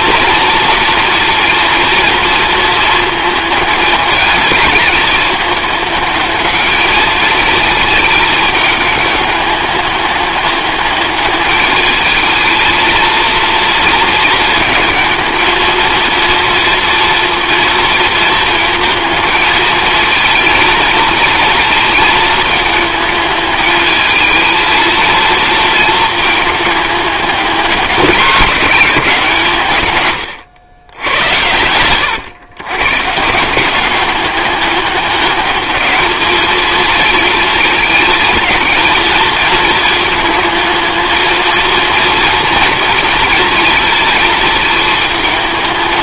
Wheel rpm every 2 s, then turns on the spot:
240, 230, 220, 220, 210, 210, 230, 220, 230, 220, 230, 220, 220, 210, 180, 100, 130, 200, 220, 230, 220, 230, 220.
none